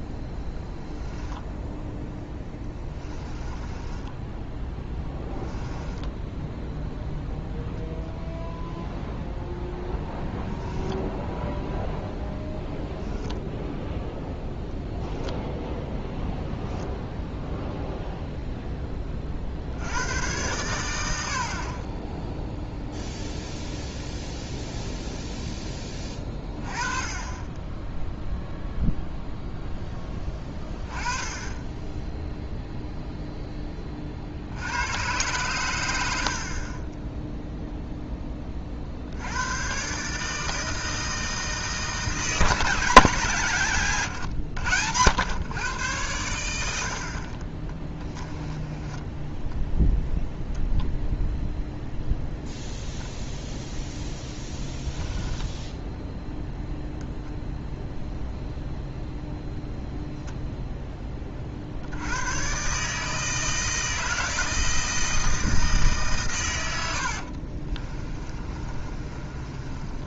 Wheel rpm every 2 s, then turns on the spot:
10, 10, 10, 0, 0, 10, 0, 10, 0, 10, 110, 0, 0, 30, 0, 20, 0, 80, 30, 30, 160, 170, 110, 80, 10, 0, 0, 0, 0, 0, 0, 130, 160, 110, 30.
0-6 10-12 36-38 48-50 68-70